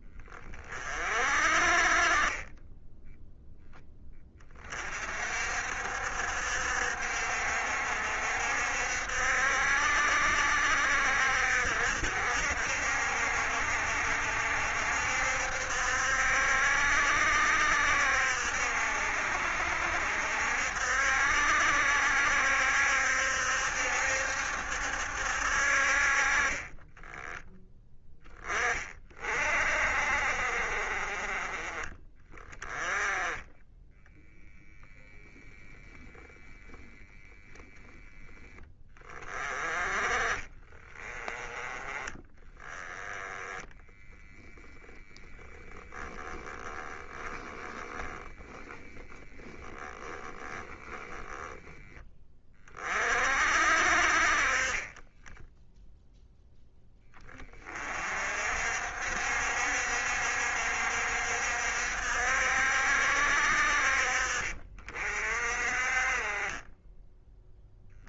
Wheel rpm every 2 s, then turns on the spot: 30, 20, 40, 60, 60, 60, 70, 70, 70, 70, 70, 70, 70, 20, 20, 30, 20, 0, 10, 20, 20, 10, 0, 10, 10, 10, 40, 30, 10, 60, 60, 60, 60, 10.
36-38 46-52